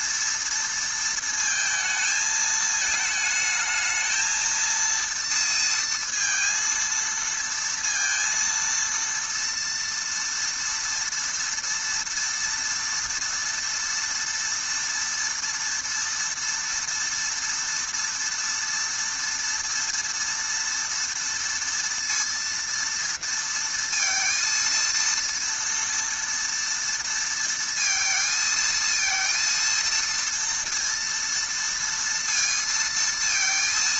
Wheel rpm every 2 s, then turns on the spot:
230, 220, 230, 230, 230, 230, 230, 230, 230, 230, 230, 230, 230, 230, 230, 230, 230.
none